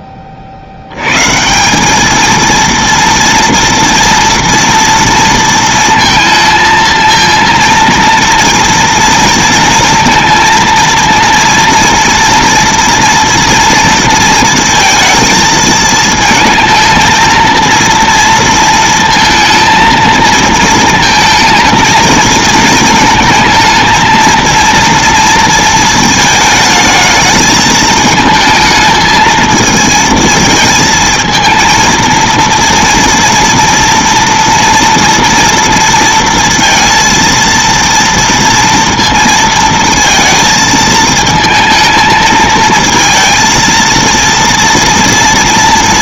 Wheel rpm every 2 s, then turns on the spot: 60, 230, 230, 230, 230, 230, 230, 230, 230, 230, 230, 220, 230, 220, 220, 220, 230, 230, 230, 230, 220, 220, 230.
none